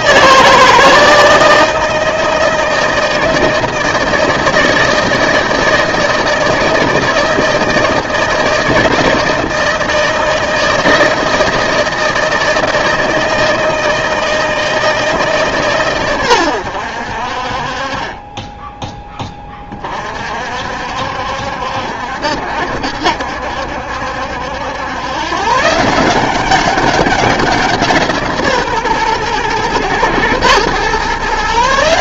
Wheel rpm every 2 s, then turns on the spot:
160, 160, 160, 160, 160, 160, 160, 160, 80, 10, 60, 70, 100, 200, 140, 120.
none